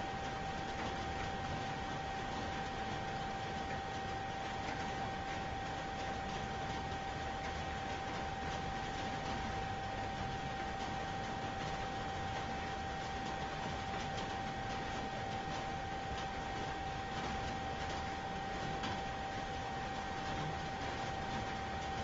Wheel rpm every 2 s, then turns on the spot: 0, 0, 0, 0, 0, 0, 0, 0, 0, 0, 0.
none